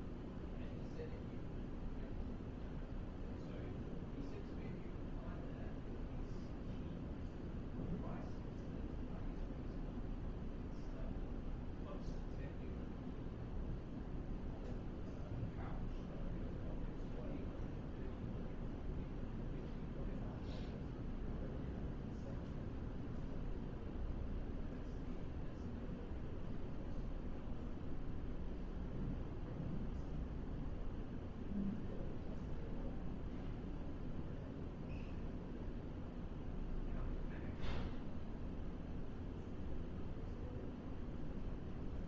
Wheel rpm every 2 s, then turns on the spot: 0, 0, 0, 0, 0, 0, 0, 0, 0, 0, 0, 0, 0, 0, 0, 0, 0, 0, 0, 0, 0.
none